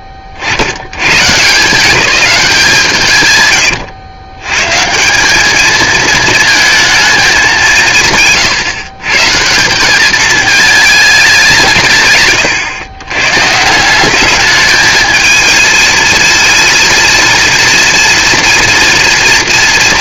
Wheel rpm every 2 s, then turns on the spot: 40, 160, 140, 220, 130, 220, 130, 210, 230, 240.
none